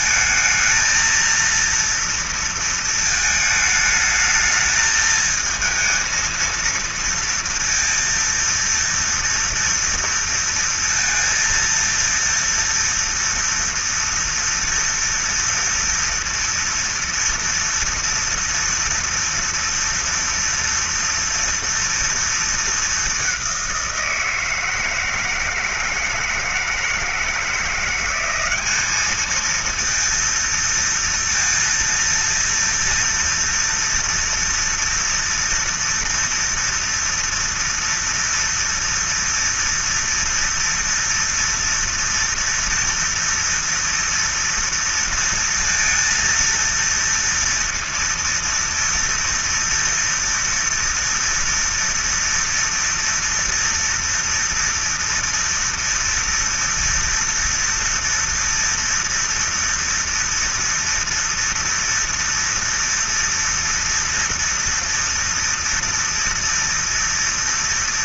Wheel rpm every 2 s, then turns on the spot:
220, 230, 220, 230, 230, 230, 230, 230, 230, 230, 230, 230, 170, 160, 190, 230, 230, 230, 230, 230, 230, 230, 230, 230, 230, 230, 230, 230, 230, 230, 230, 230, 230, 230.
none